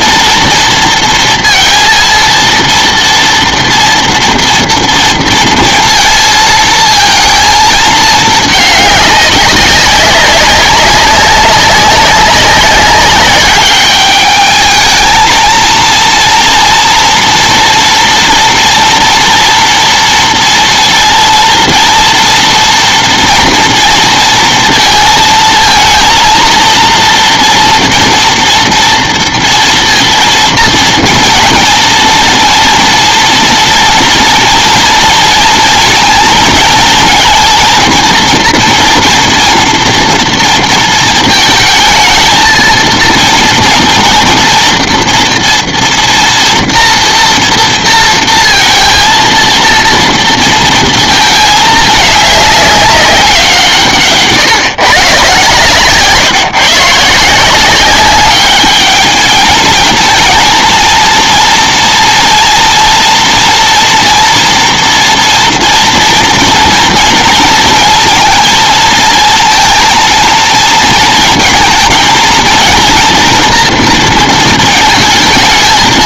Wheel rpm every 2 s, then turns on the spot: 230, 230, 230, 230, 210, 200, 200, 210, 230, 230, 230, 230, 230, 230, 240, 230, 230, 230, 220, 230, 230, 230, 240, 240, 230, 230, 200, 150, 150, 210, 230, 230, 240, 230, 220, 230, 230, 220.
none